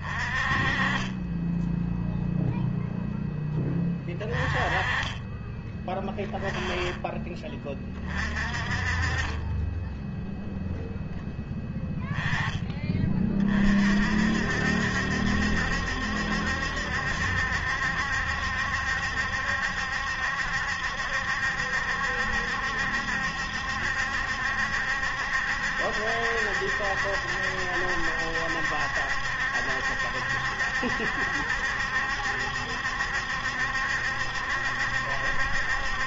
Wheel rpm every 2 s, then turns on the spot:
30, 0, 20, 20, 30, 0, 30, 70, 70, 70, 70, 70, 70, 70, 70, 70, 70, 70.
none